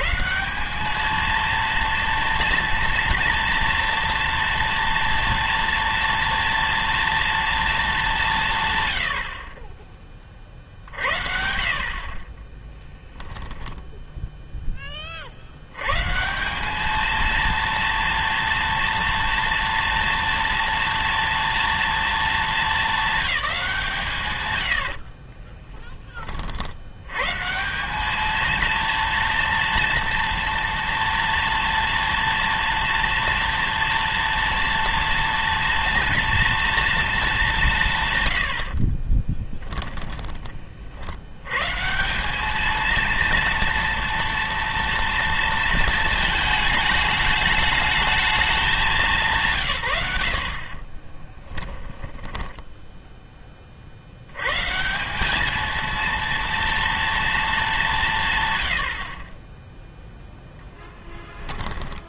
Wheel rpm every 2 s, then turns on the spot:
190, 230, 230, 230, 140, 60, 10, 10, 200, 230, 230, 210, 100, 50, 230, 230, 230, 230, 230, 70, 40, 220, 230, 220, 210, 50, 10, 150, 230, 110, 10.
12-14 50-54 60-62